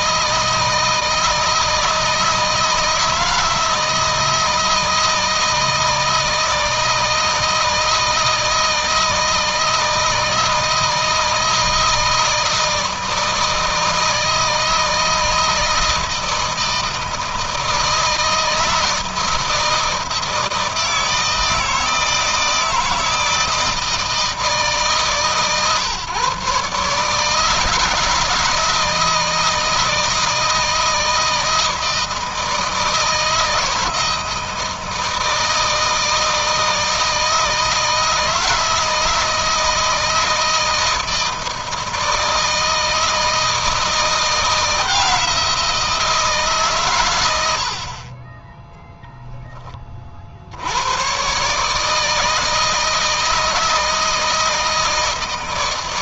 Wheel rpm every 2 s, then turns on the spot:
160, 160, 160, 160, 160, 160, 160, 160, 160, 160, 160, 160, 160, 150, 160, 160, 160, 160, 160, 160, 160, 160, 170, 120, 0, 100, 160, 160.
none